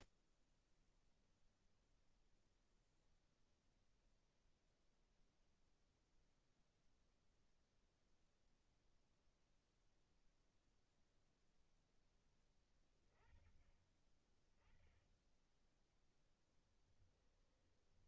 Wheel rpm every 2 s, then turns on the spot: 0, 0, 0, 0, 0, 0, 20, 20, 10.
16-18